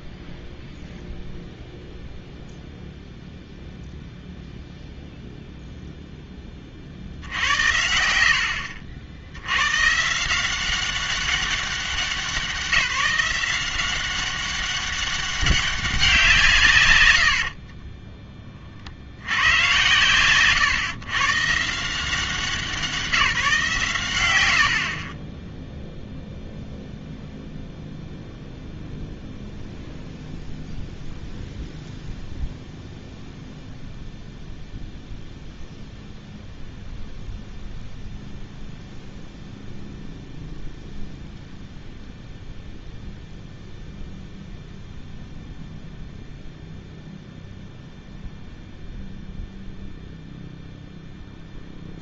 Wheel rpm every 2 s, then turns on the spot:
0, 0, 0, 70, 70, 190, 180, 200, 130, 40, 120, 180, 80, 0, 0, 0, 0, 0, 0, 0, 0, 0, 0, 0, 0, 0.
none